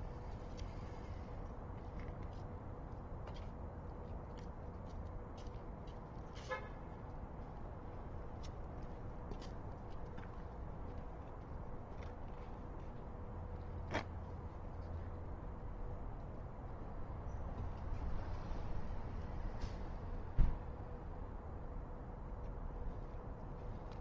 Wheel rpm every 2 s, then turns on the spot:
0, 0, 0, 0, 0, 0, 0, 0, 0, 0, 0, 0.
none